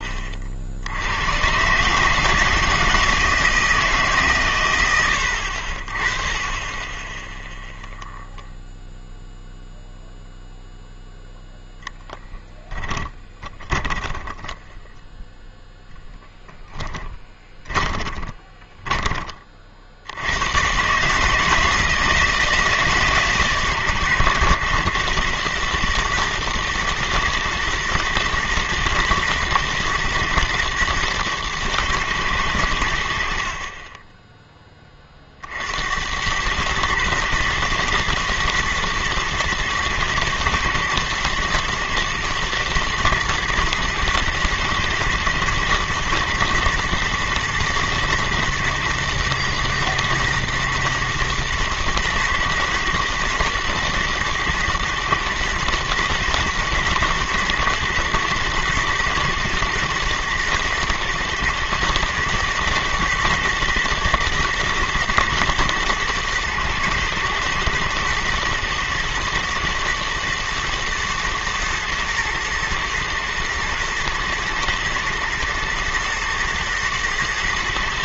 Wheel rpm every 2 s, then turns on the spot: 90, 160, 80, 0, 0, 0, 20, 0, 10, 30, 150, 140, 120, 110, 110, 110, 50, 40, 110, 110, 110, 110, 110, 110, 110, 120, 120, 110, 110, 120, 110, 110, 120, 120, 110, 120, 120, 120, 110.
12-14 16-18